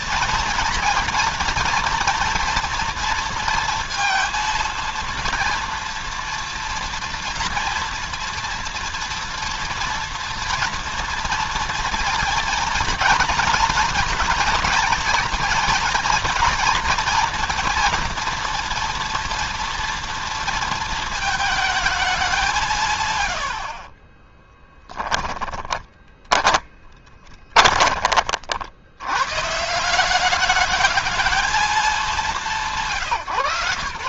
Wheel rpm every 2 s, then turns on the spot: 230, 240, 230, 230, 230, 230, 230, 230, 230, 240, 230, 180, 10, 20, 50, 210, 150.
24-28